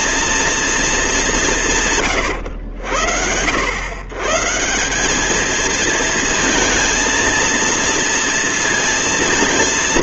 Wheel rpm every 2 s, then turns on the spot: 220, 90, 170, 230, 230.
none